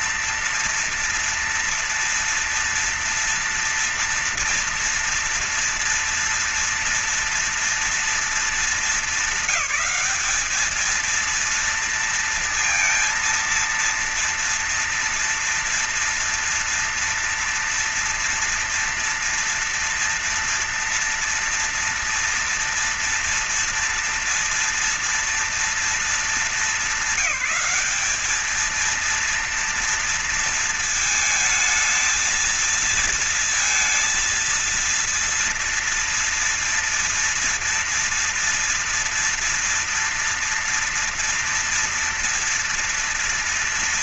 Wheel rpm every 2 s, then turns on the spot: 230, 230, 230, 230, 230, 220, 230, 230, 230, 230, 230, 230, 230, 220, 220, 230, 230, 230, 230, 230, 230, 230.
none